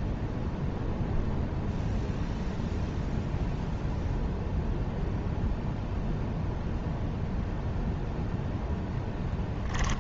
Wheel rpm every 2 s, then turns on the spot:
0, 0, 0, 0, 0.
none